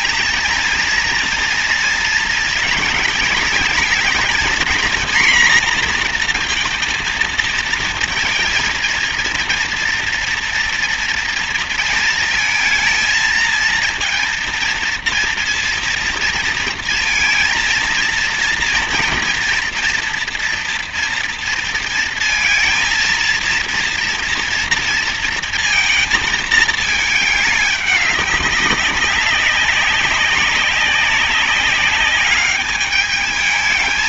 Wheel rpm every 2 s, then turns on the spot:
230, 220, 240, 230, 230, 230, 230, 230, 230, 230, 230, 220, 230, 220, 190, 190, 210.
none